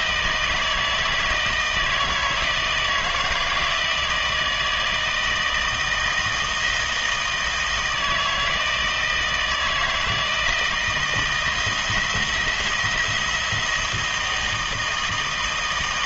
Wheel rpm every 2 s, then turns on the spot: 160, 160, 160, 160, 160, 160, 170, 160.
none